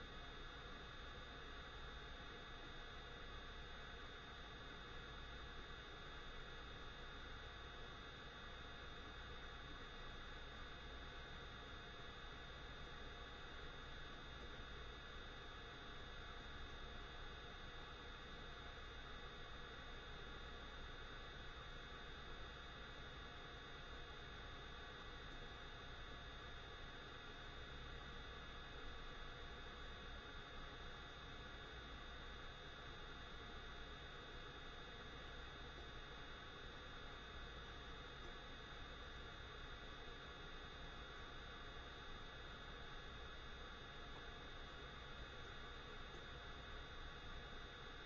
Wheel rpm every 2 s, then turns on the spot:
0, 0, 0, 0, 0, 0, 0, 0, 0, 0, 0, 0, 0, 0, 0, 0, 0, 0, 0, 0, 0, 0, 0, 0.
none